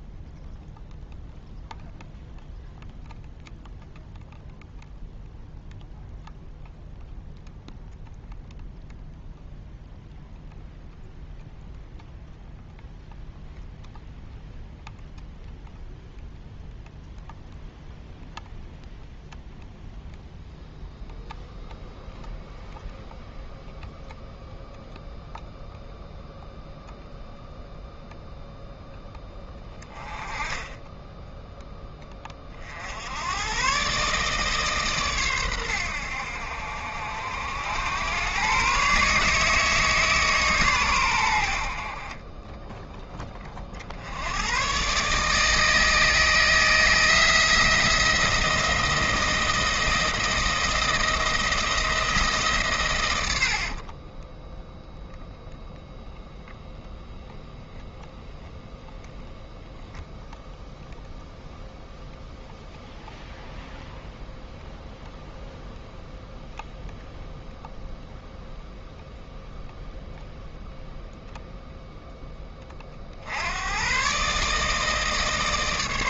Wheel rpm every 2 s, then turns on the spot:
0, 0, 0, 0, 0, 0, 0, 0, 0, 0, 0, 0, 0, 0, 0, 20, 50, 150, 70, 130, 130, 10, 120, 160, 170, 170, 140, 10, 0, 0, 0, 0, 0, 0, 0, 0, 30, 150.
42-44